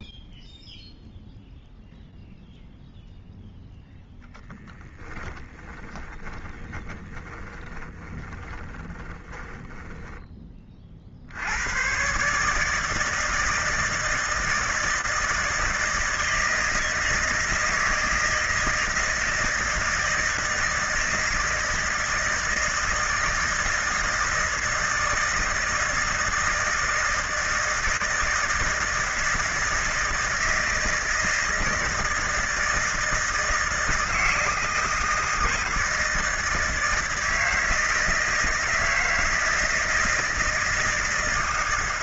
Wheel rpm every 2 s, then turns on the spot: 0, 0, 10, 20, 20, 20, 140, 160, 160, 160, 160, 160, 160, 160, 160, 160, 160, 160, 160, 160, 160.
4-10